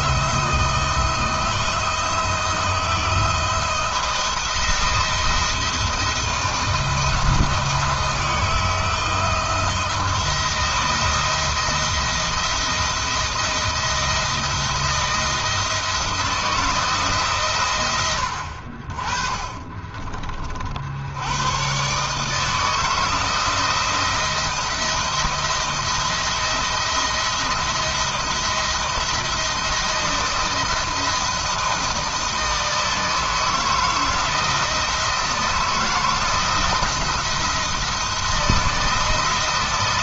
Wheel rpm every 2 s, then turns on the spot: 170, 170, 170, 170, 160, 170, 170, 160, 150, 40, 70, 160, 170, 160, 170, 160, 170, 160, 170, 160.
none